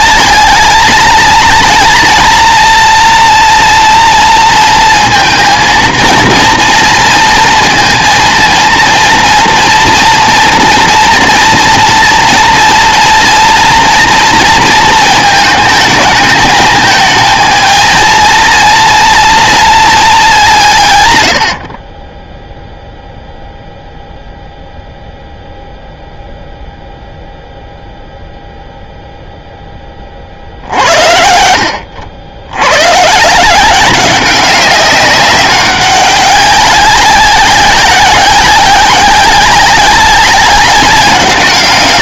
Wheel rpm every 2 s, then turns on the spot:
220, 230, 230, 230, 220, 230, 240, 230, 220, 230, 170, 0, 0, 0, 0, 50, 100, 190, 190, 190, 200.
none